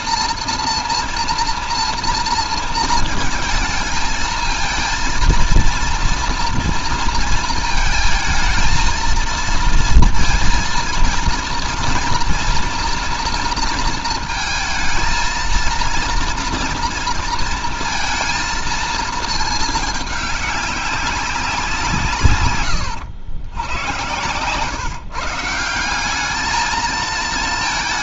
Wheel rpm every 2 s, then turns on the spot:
230, 230, 220, 230, 230, 230, 230, 220, 230, 220, 210, 130, 130, 210.
22-24